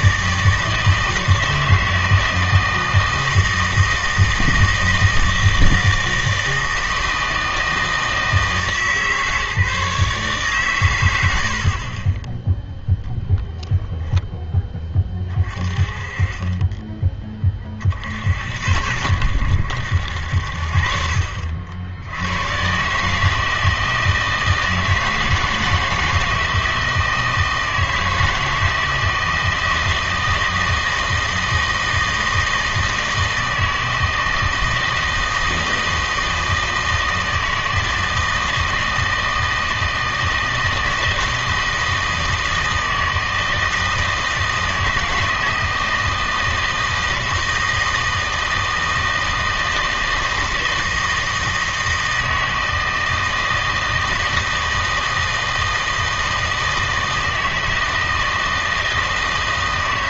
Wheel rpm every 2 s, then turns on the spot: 160, 160, 160, 160, 160, 130, 0, 10, 20, 80, 60, 130, 160, 160, 160, 160, 160, 160, 160, 160, 160, 160, 160, 160, 160, 160, 160, 160, 160, 160.
none